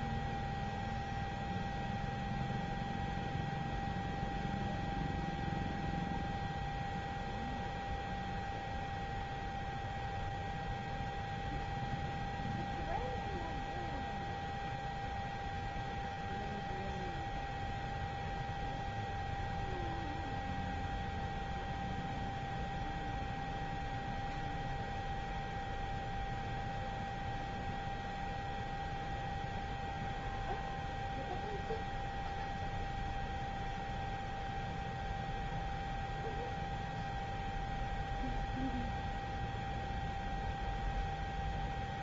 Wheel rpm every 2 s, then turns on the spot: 0, 0, 0, 0, 0, 0, 0, 0, 0, 0, 0, 0, 0, 0, 0, 0, 0, 0, 0, 0, 0.
none